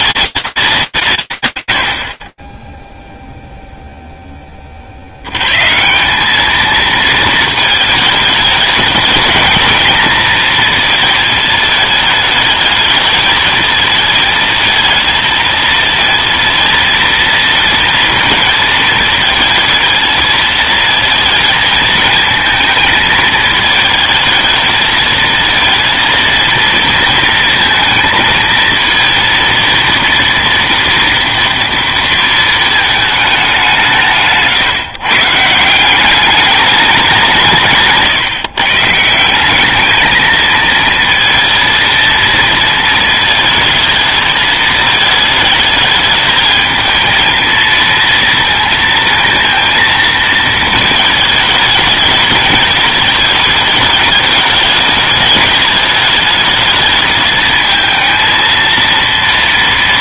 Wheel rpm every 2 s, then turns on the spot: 210, 20, 40, 220, 220, 220, 220, 230, 230, 230, 220, 220, 220, 230, 230, 230, 220, 140, 210, 150, 230, 230, 220, 220, 230, 220, 210, 210, 220, 230.
none